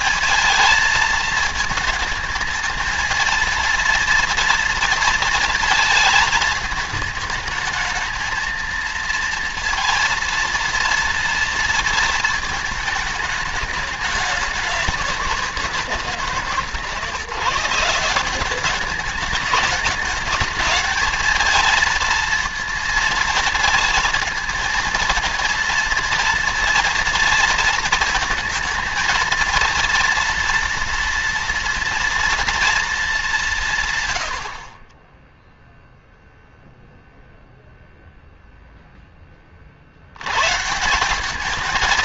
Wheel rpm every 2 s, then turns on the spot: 220, 220, 230, 220, 230, 230, 220, 200, 150, 190, 210, 230, 230, 230, 220, 230, 230, 70, 0, 0, 130.
none